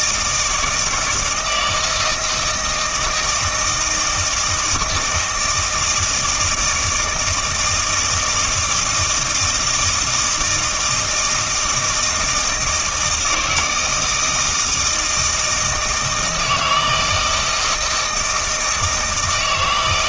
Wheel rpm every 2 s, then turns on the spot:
160, 160, 160, 160, 160, 160, 160, 160, 160, 160.
none